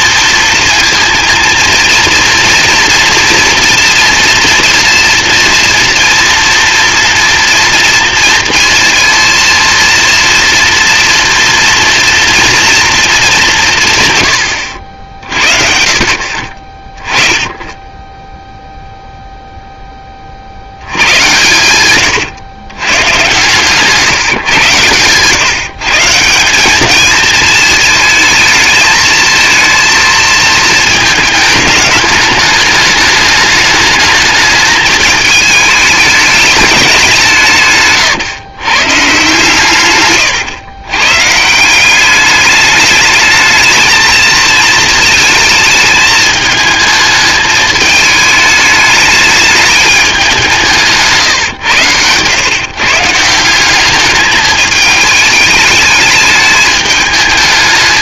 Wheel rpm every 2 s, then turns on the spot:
230, 230, 240, 230, 230, 230, 230, 70, 30, 0, 80, 110, 130, 190, 220, 220, 210, 210, 210, 120, 120, 210, 230, 220, 210, 160, 130, 210, 210.
none